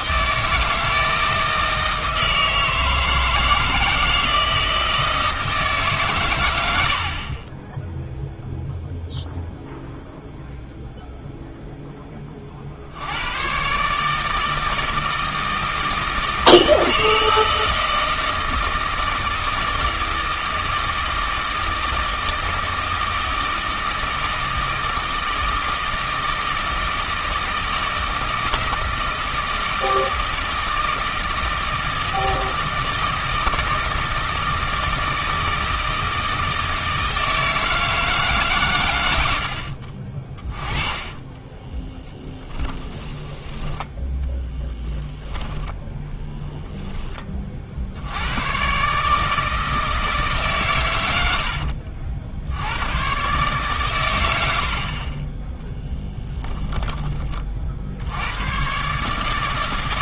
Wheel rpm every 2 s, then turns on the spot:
160, 160, 160, 80, 0, 0, 60, 160, 160, 160, 160, 160, 160, 160, 160, 160, 160, 160, 160, 110, 20, 10, 10, 10, 130, 110, 90, 60, 10, 120.
40-44